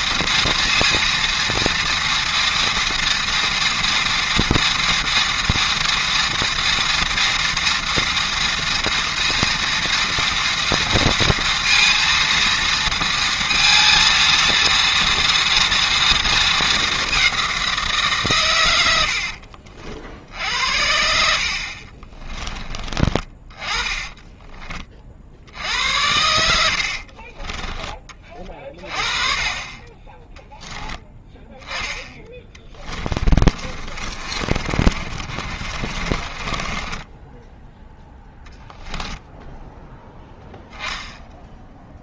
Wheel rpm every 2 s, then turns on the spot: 230, 230, 230, 230, 230, 230, 230, 230, 220, 110, 70, 20, 20, 80, 40, 10, 10, 40, 20, 0, 10.
26-28 32-38